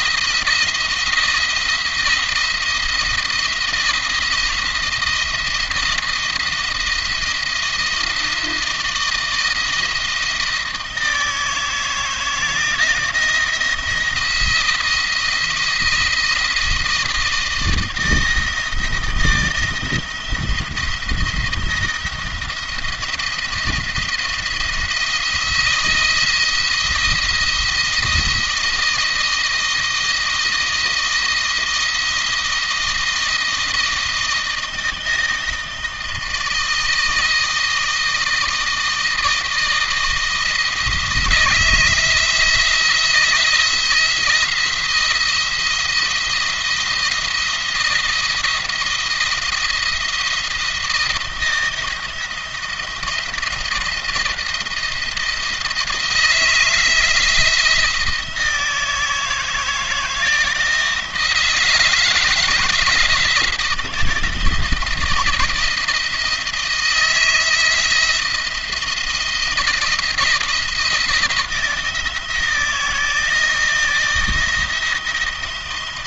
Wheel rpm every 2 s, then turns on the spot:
170, 170, 170, 170, 170, 160, 170, 170, 160, 160, 170, 170, 170, 170, 170, 160, 160, 160, 160, 160, 160, 170, 170, 170, 170, 170, 170, 170, 160, 160, 160, 160, 160, 160, 170, 170, 160, 170.
none